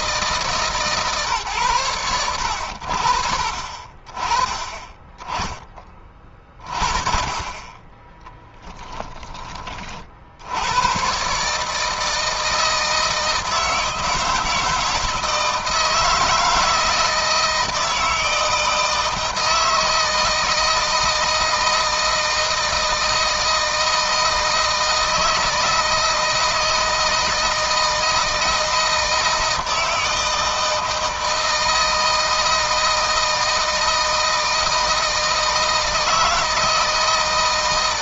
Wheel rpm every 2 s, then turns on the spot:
150, 80, 20, 40, 10, 90, 160, 160, 160, 160, 160, 160, 160, 160, 160, 160, 160, 160, 160.
none